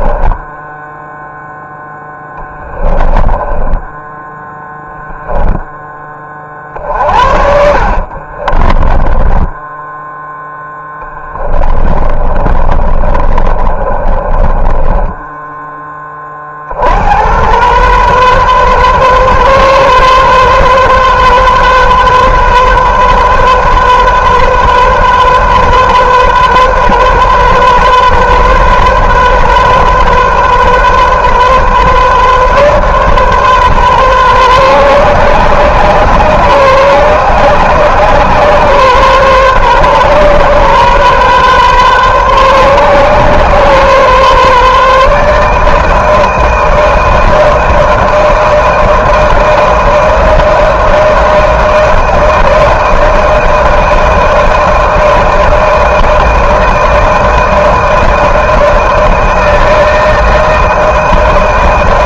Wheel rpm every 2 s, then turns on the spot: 10, 10, 10, 30, 30, 10, 30, 20, 40, 130, 130, 130, 130, 130, 130, 130, 140, 130, 130, 130, 130, 130, 140, 160, 160, 160, 160, 160, 160, 160, 160.
0-10 12-16